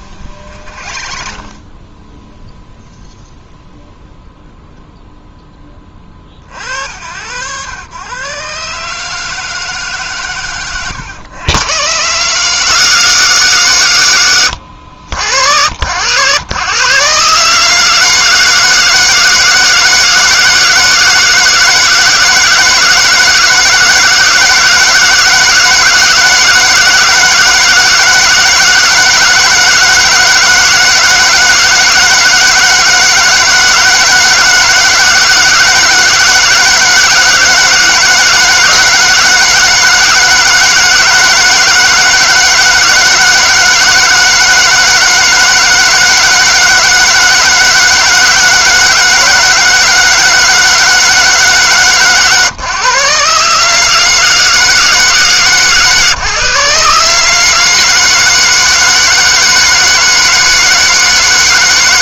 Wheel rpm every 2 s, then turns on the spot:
30, 0, 0, 70, 150, 100, 150, 80, 120, 160, 160, 160, 160, 160, 160, 160, 160, 160, 160, 160, 160, 160, 160, 160, 160, 160, 120, 160, 140, 160, 160.
0-2